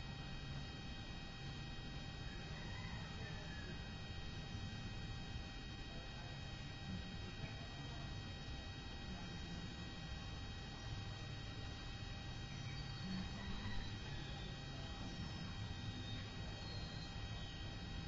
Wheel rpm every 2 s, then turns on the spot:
0, 0, 0, 0, 0, 0, 0, 0, 0.
none